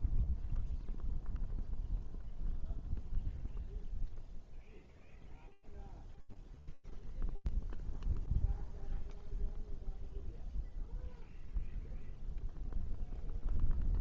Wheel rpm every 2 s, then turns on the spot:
0, 0, 0, 0, 0, 0, 0.
none